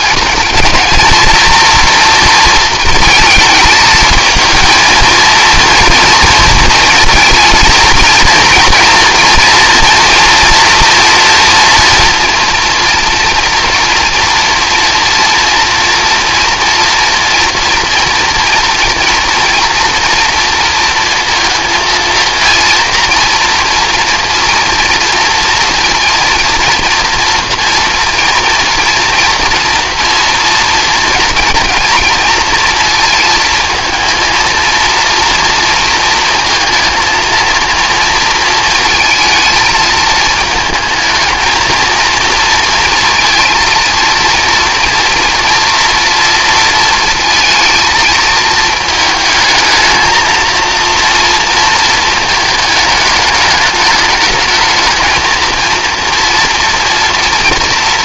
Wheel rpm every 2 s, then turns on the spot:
230, 230, 220, 230, 230, 230, 240, 230, 230, 240, 230, 230, 230, 230, 230, 230, 230, 230, 230, 230, 220, 230, 230, 230, 230, 230, 220, 220, 240.
none